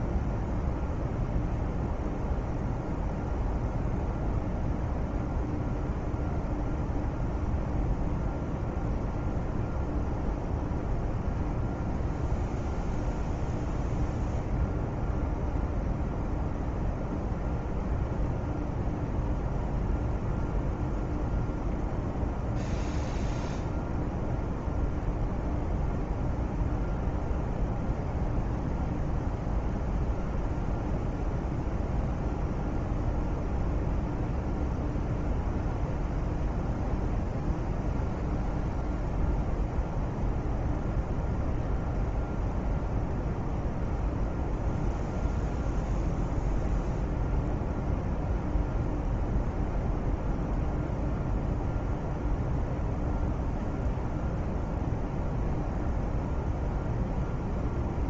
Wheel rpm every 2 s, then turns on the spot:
0, 0, 0, 0, 0, 0, 0, 0, 0, 0, 0, 0, 0, 0, 0, 0, 0, 0, 0, 0, 0, 0, 0, 0, 0, 0, 0, 0, 0.
none